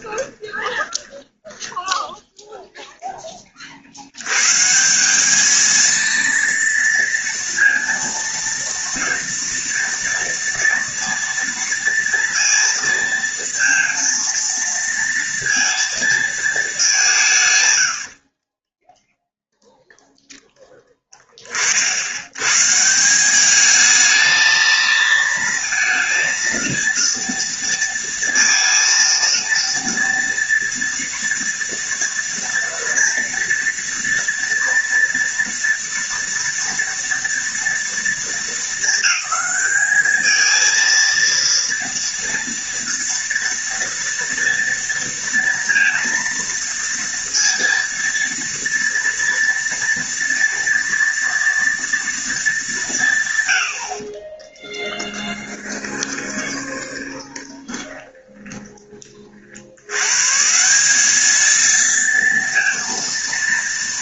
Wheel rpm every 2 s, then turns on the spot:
20, 10, 180, 230, 230, 230, 230, 230, 190, 10, 20, 170, 230, 230, 230, 230, 230, 230, 230, 220, 230, 230, 230, 230, 230, 230, 170, 10, 20, 40, 200, 230.
0-2 18-20 54-60